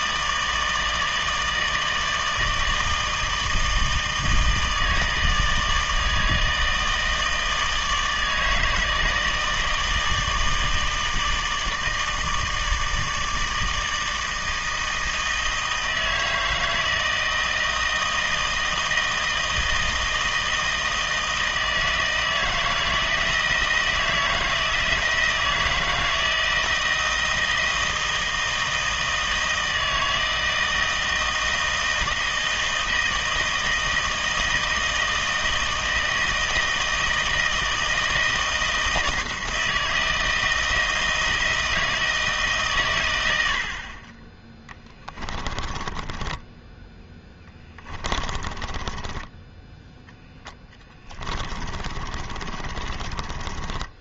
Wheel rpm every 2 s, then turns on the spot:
160, 160, 160, 160, 150, 160, 160, 160, 160, 160, 160, 160, 160, 160, 160, 160, 160, 160, 160, 160, 160, 150, 10, 10, 20, 10, 40.
46-54